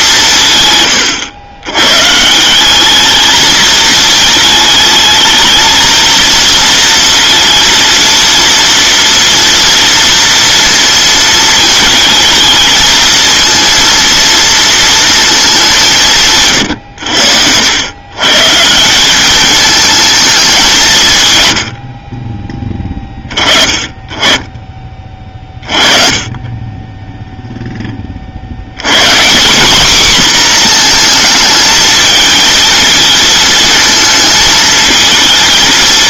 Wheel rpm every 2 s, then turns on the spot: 130, 190, 220, 230, 230, 230, 220, 230, 120, 160, 190, 20, 20, 20, 100, 230, 220, 220.
none